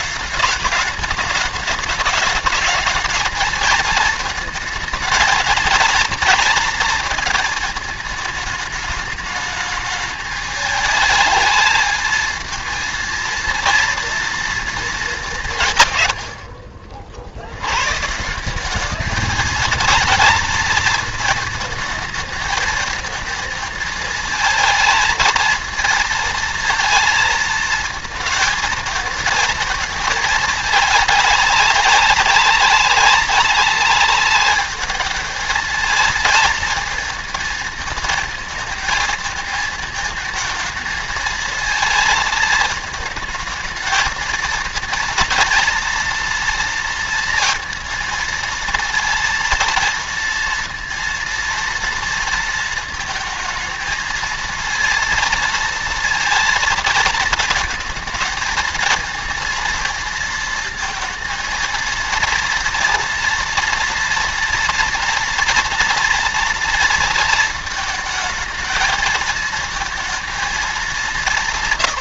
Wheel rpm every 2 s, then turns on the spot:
210, 220, 220, 230, 210, 210, 220, 230, 80, 200, 230, 220, 230, 230, 220, 210, 200, 210, 220, 220, 220, 220, 230, 230, 230, 230, 230, 230, 230, 220, 230, 230, 230, 230, 220, 210.
none